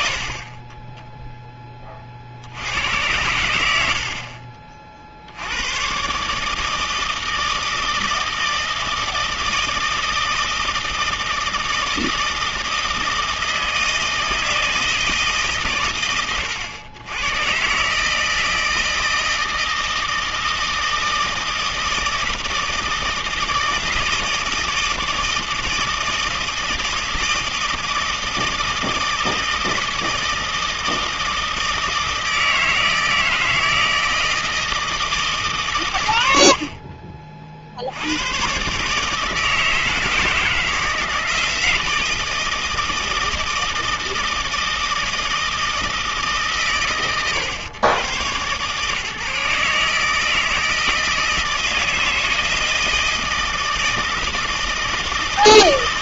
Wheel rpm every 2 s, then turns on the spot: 30, 100, 50, 160, 160, 160, 160, 160, 110, 160, 160, 160, 160, 160, 160, 160, 160, 160, 40, 130, 160, 160, 160, 140, 140, 160, 160, 160.
0-2